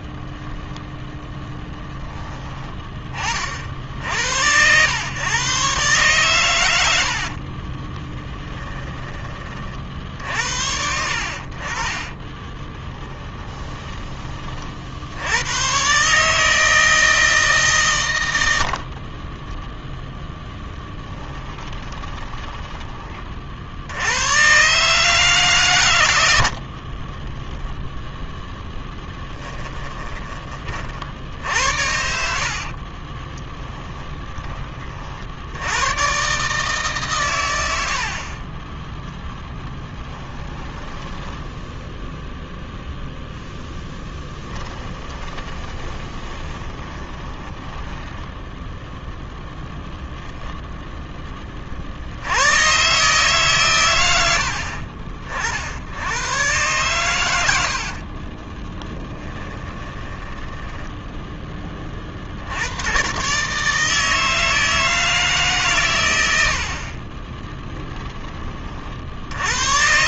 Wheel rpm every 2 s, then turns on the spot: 0, 20, 100, 90, 10, 60, 20, 60, 160, 50, 10, 20, 150, 40, 10, 40, 60, 40, 150, 10, 10, 0, 20, 20, 0, 0, 130, 50, 120, 20, 10, 110, 160, 50, 50.
8-10 12-14 18-22 26-30 32-34 40-42 44-48 58-62